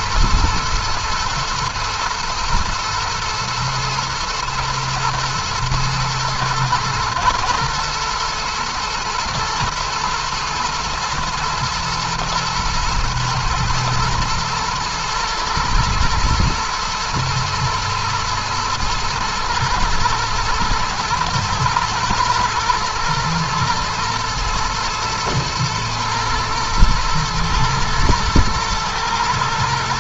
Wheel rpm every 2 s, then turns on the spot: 110, 120, 110, 110, 120, 120, 120, 110, 110, 110, 110, 110, 110, 110, 110.
none